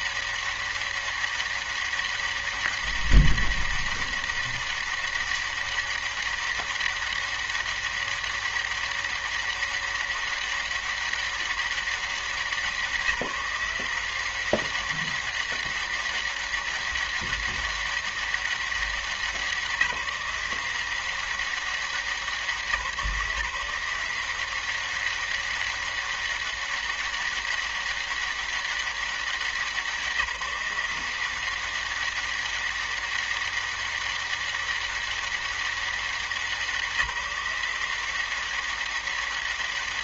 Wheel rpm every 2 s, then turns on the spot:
200, 200, 200, 200, 200, 200, 190, 180, 200, 200, 180, 190, 170, 200, 200, 170, 190, 200, 180, 180.
none